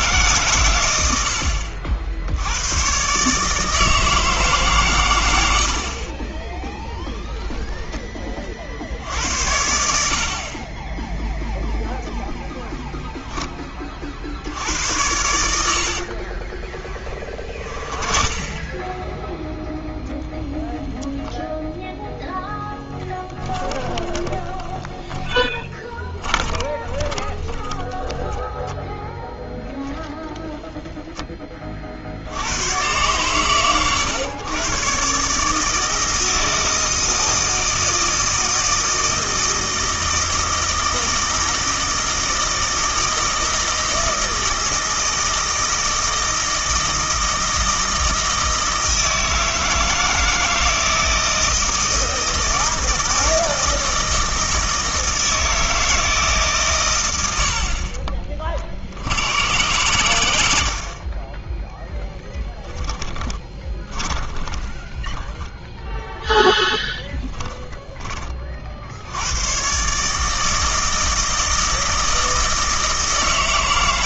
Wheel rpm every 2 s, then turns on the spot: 120, 100, 140, 20, 50, 30, 10, 70, 30, 10, 0, 0, 10, 20, 0, 0, 110, 120, 160, 160, 160, 160, 160, 160, 160, 160, 160, 160, 140, 40, 70, 10, 10, 0, 40, 160, 160.
6-8 12-14 16-18 24-28 62-66